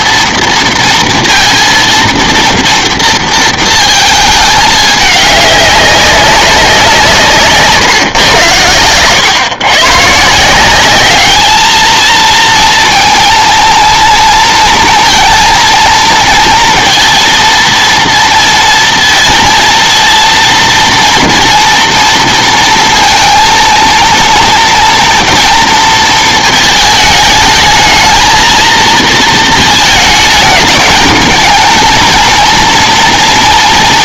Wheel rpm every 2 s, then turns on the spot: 230, 230, 210, 190, 110, 180, 230, 230, 230, 230, 230, 230, 230, 220, 220, 220, 230.
none